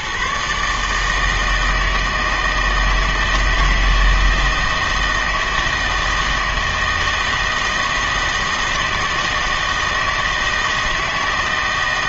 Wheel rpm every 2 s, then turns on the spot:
150, 160, 160, 160, 160, 160.
none